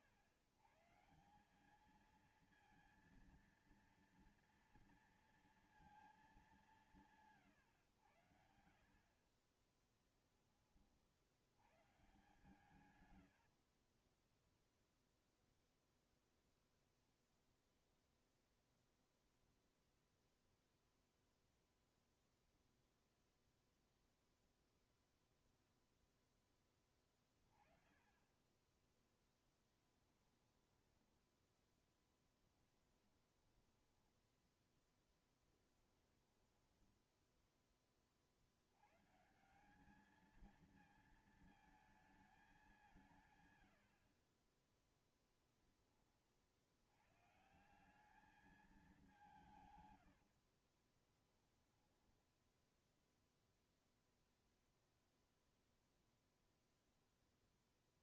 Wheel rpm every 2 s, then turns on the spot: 130, 230, 230, 190, 70, 20, 120, 10, 0, 0, 0, 0, 0, 10, 20, 10, 10, 10, 10, 60, 210, 200, 40, 70, 200, 70, 10, 0, 0.
14-16 28-38 44-46 50-54